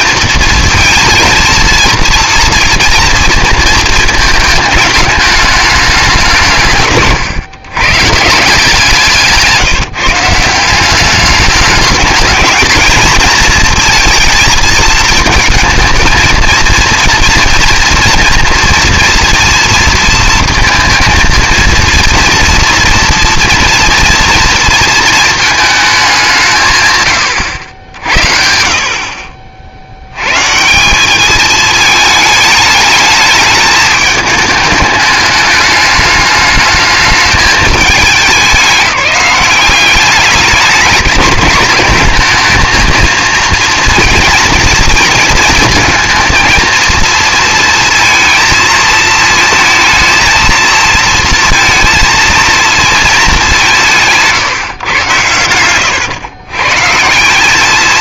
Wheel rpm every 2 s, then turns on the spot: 230, 230, 220, 150, 170, 190, 220, 220, 230, 230, 230, 230, 230, 140, 50, 180, 210, 210, 220, 190, 210, 230, 230, 230, 220, 230, 230, 130, 140.
none